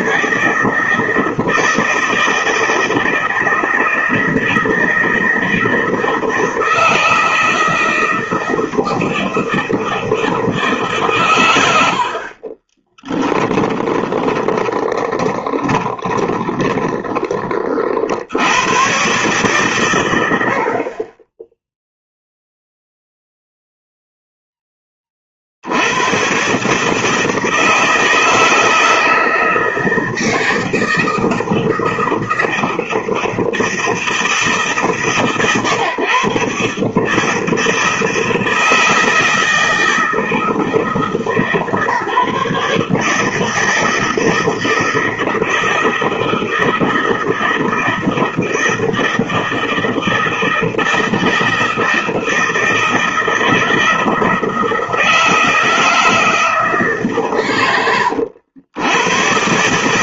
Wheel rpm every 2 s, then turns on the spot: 150, 160, 160, 160, 160, 160, 30, 10, 20, 90, 70, 0, 10, 130, 160, 160, 160, 140, 130, 160, 160, 150, 160, 160, 160, 160, 160, 160, 160, 90.
12-18